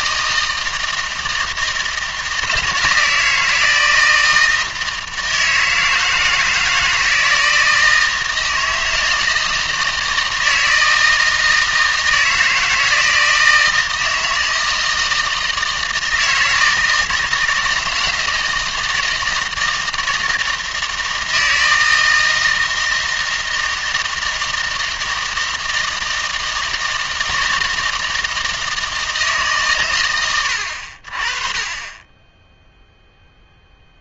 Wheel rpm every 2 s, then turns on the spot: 160, 160, 160, 160, 160, 160, 160, 160, 160, 160, 160, 160, 160, 160, 160, 80, 0.
none